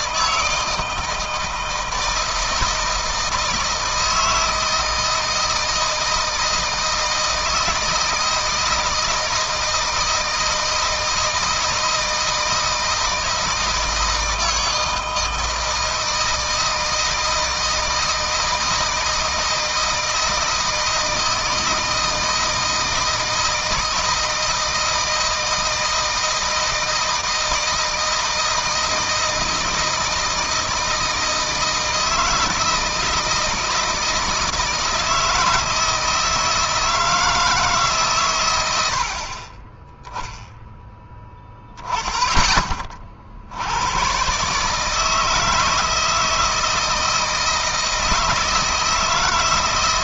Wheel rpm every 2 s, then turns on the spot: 160, 160, 160, 160, 160, 160, 160, 160, 160, 160, 160, 160, 160, 160, 160, 160, 160, 160, 160, 70, 0, 30, 150, 160, 160.
none